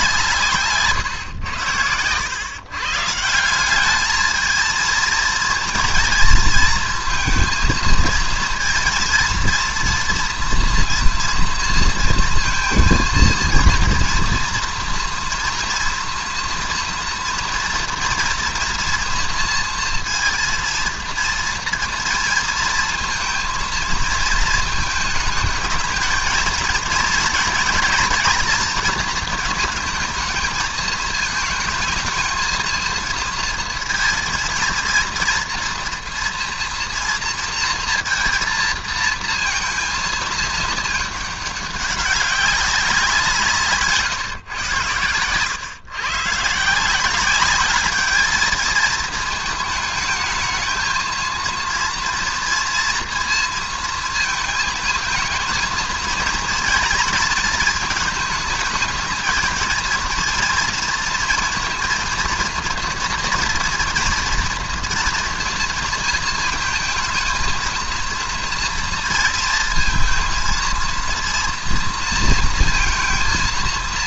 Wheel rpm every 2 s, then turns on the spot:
150, 120, 220, 230, 230, 230, 230, 230, 230, 230, 230, 230, 220, 230, 230, 220, 220, 230, 230, 230, 220, 190, 120, 150, 220, 220, 230, 220, 230, 220, 230, 230, 230, 230, 230, 230, 230.
none